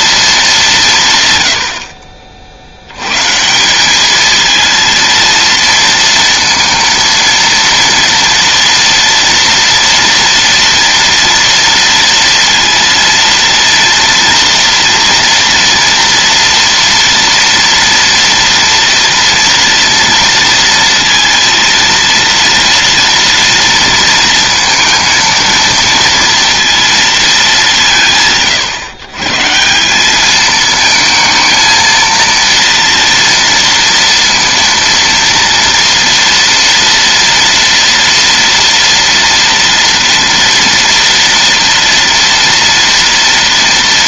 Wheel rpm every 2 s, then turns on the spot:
170, 80, 230, 230, 230, 230, 230, 240, 240, 230, 230, 230, 230, 230, 130, 220, 230, 230, 230, 230, 230, 230.
none